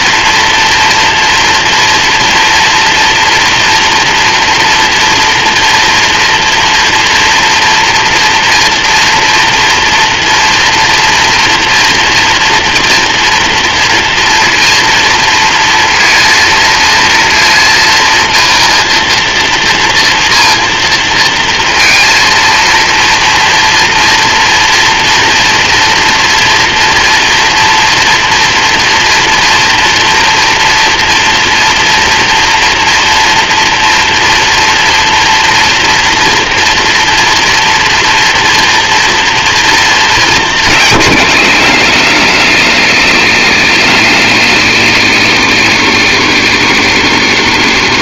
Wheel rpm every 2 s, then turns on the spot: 240, 240, 230, 230, 230, 230, 230, 230, 230, 230, 230, 230, 230, 240, 240, 230, 230, 230, 230, 230, 140, 80, 80, 70.
none